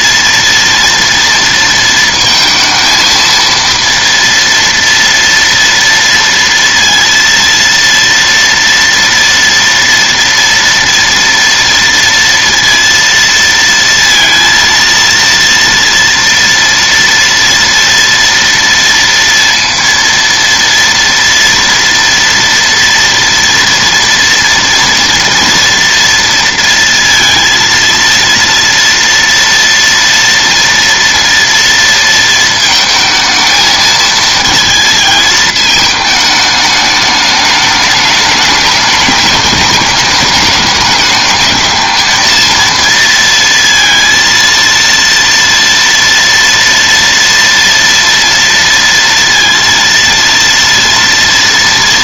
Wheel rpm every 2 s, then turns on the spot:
230, 230, 230, 230, 230, 230, 230, 230, 230, 230, 230, 240, 230, 230, 230, 230, 220, 220, 210, 210, 210, 230, 230, 230, 230, 230.
none